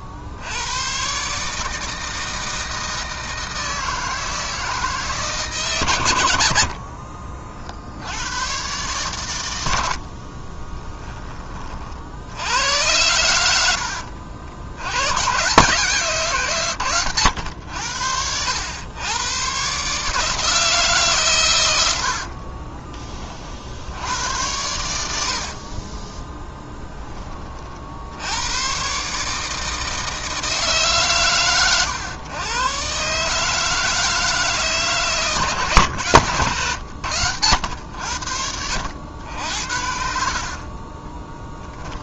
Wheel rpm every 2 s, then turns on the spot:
110, 160, 160, 60, 120, 30, 100, 80, 130, 100, 150, 30, 80, 10, 120, 140, 120, 150, 120, 80, 30.
6-8 10-12 22-24